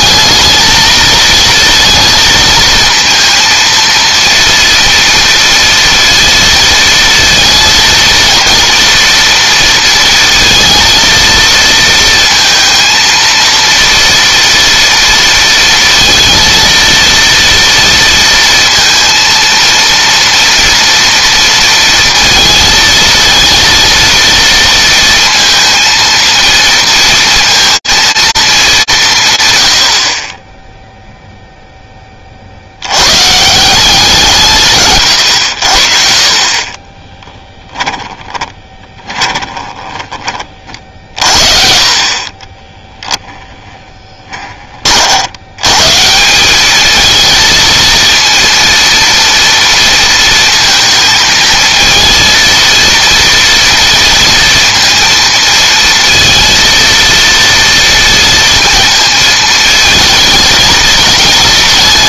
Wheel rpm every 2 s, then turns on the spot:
220, 230, 230, 230, 230, 230, 230, 230, 230, 230, 230, 230, 230, 230, 180, 0, 80, 130, 30, 20, 50, 10, 30, 200, 230, 230, 230, 230, 230, 230, 220.
38-40 42-44